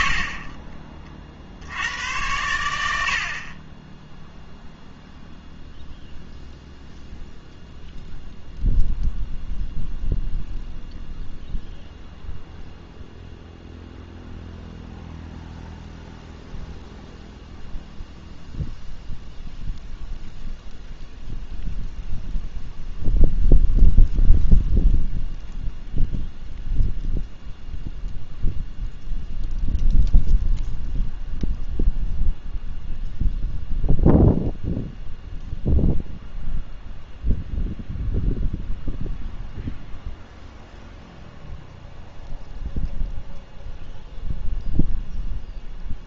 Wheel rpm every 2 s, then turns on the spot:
50, 90, 0, 0, 0, 0, 0, 0, 0, 0, 0, 0, 0, 0, 0, 0, 0, 0, 0, 0, 0, 0, 0.
none